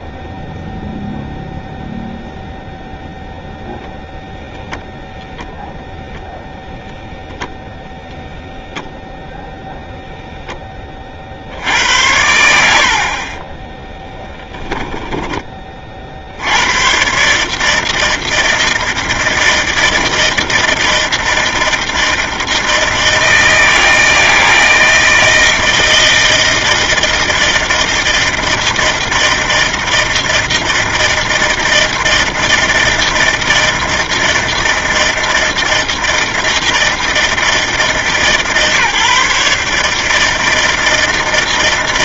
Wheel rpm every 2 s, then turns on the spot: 0, 0, 0, 0, 0, 10, 80, 10, 90, 160, 160, 160, 160, 160, 160, 160, 160, 160, 160, 150, 160.
14-16